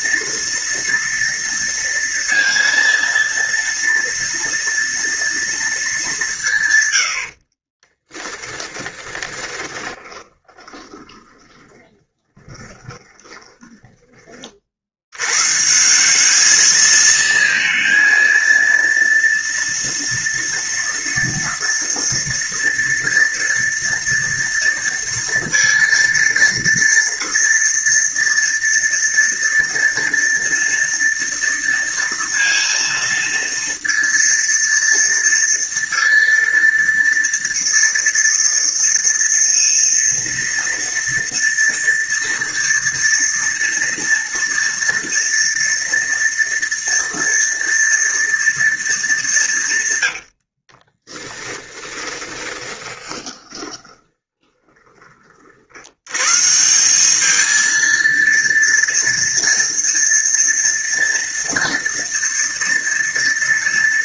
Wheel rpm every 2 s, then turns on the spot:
230, 230, 230, 180, 20, 20, 20, 30, 190, 230, 230, 230, 230, 230, 230, 230, 230, 230, 230, 230, 230, 230, 230, 230, 230, 90, 20, 20, 120, 230, 240, 230.
8-14 50-56